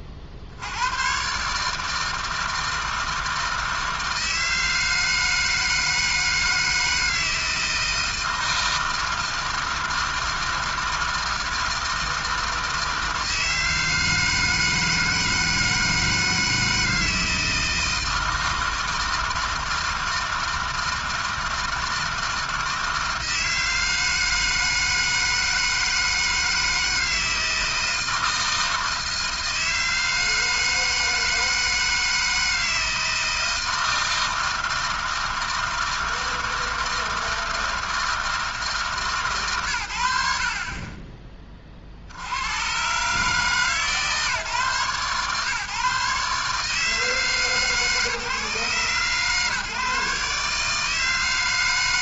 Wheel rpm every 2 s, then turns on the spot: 80, 160, 160, 160, 160, 160, 160, 160, 160, 160, 160, 160, 160, 160, 160, 160, 160, 160, 160, 160, 20, 100, 140, 150, 140, 150.
none